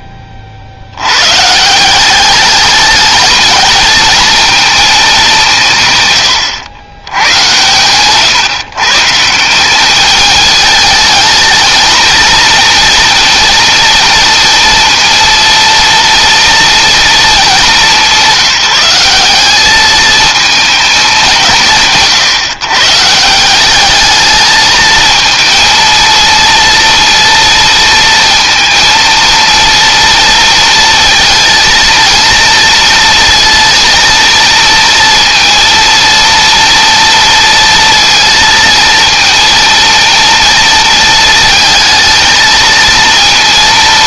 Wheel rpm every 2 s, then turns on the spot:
50, 200, 230, 110, 150, 210, 230, 230, 230, 190, 220, 130, 220, 230, 230, 230, 230, 230, 230, 230, 230, 230.
none